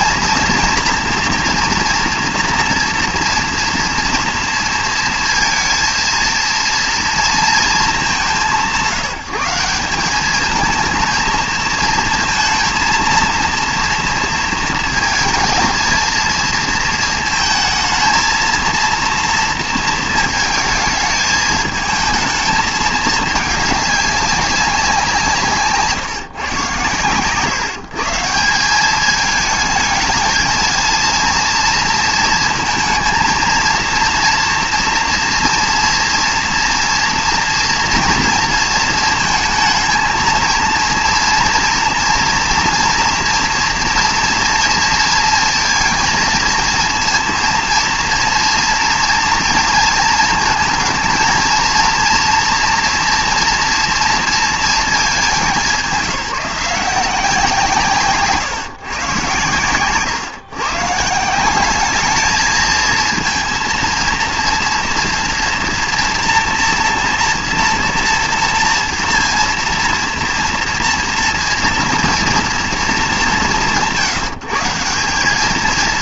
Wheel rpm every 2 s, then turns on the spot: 230, 230, 230, 230, 170, 220, 230, 230, 230, 230, 220, 220, 190, 140, 180, 220, 230, 230, 230, 230, 230, 230, 230, 230, 230, 220, 230, 220, 180, 140, 140, 220, 230, 230, 230, 230, 230, 160.
none